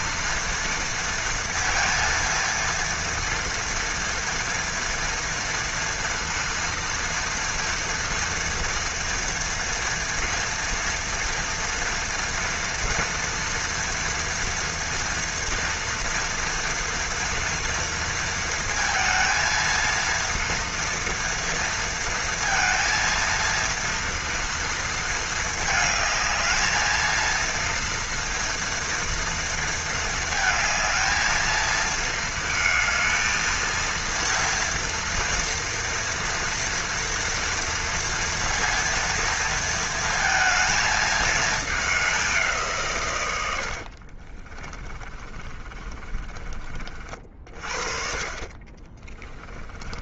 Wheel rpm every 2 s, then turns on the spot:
230, 230, 230, 230, 230, 230, 230, 230, 230, 230, 230, 230, 230, 220, 230, 220, 220, 230, 230, 230, 220, 150, 20, 40, 20.
44-46 48-50